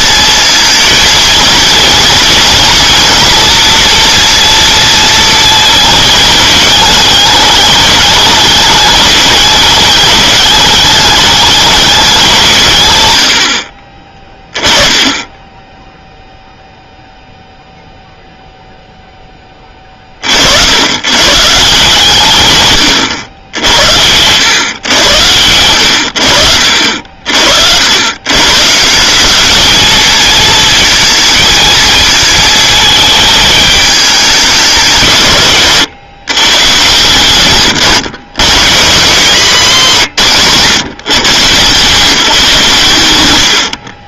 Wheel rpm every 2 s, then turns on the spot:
230, 230, 230, 220, 210, 210, 140, 20, 0, 0, 100, 120, 110, 60, 150, 220, 220, 190, 140, 150, 140, 140.
none